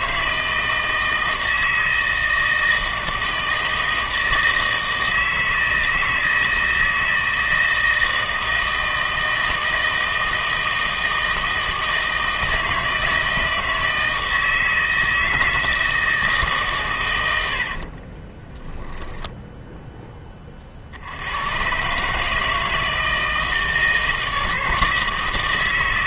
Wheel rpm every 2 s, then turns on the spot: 160, 160, 160, 160, 160, 160, 160, 160, 140, 10, 40, 160, 160.
18-20